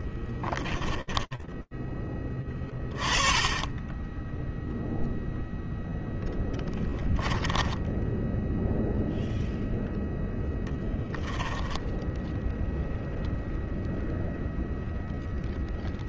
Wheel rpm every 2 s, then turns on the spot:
10, 10, 0, 10, 0, 10, 0, 0.
6-8 10-12